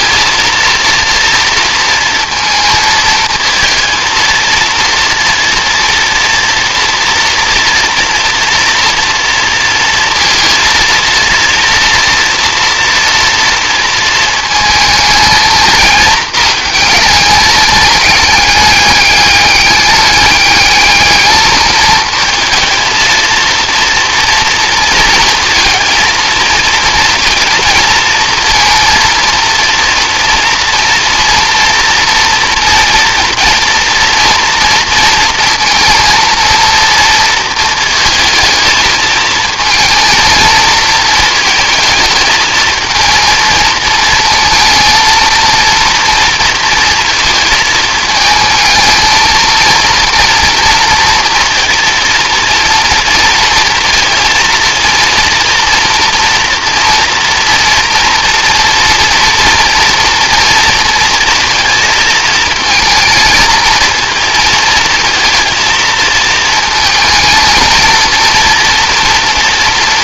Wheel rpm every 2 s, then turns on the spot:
230, 230, 230, 230, 230, 230, 230, 220, 220, 210, 210, 220, 230, 230, 230, 230, 230, 230, 230, 220, 220, 220, 230, 230, 220, 230, 230, 230, 240, 230, 230, 220, 230, 230, 230.
none